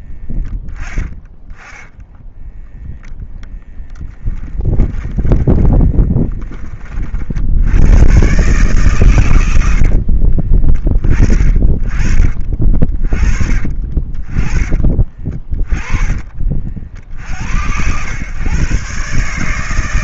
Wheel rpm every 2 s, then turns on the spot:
10, 0, 20, 20, 130, 40, 40, 40, 40, 120.
0-2 4-6 10-12